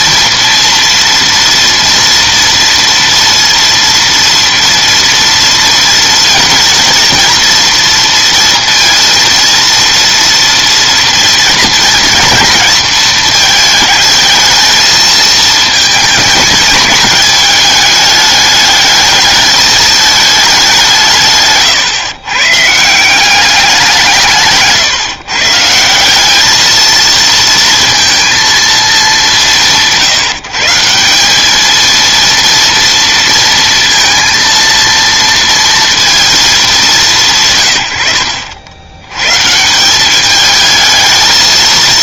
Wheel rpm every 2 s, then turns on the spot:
230, 230, 230, 230, 230, 230, 220, 220, 220, 210, 190, 140, 150, 220, 220, 160, 230, 230, 210, 70, 210.
none